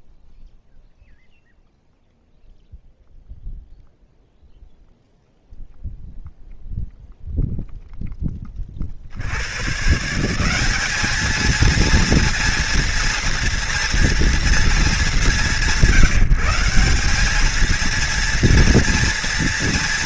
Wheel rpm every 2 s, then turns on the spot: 0, 0, 0, 0, 50, 210, 240, 200, 190, 230.
none